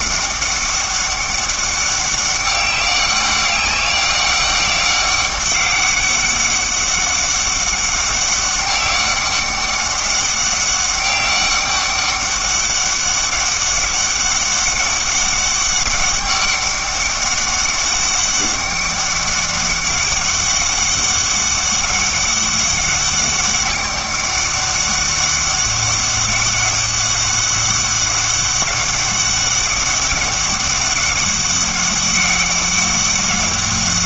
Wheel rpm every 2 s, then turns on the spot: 200, 190, 190, 190, 200, 200, 200, 200, 200, 200, 200, 200, 200, 200, 200, 200, 200.
none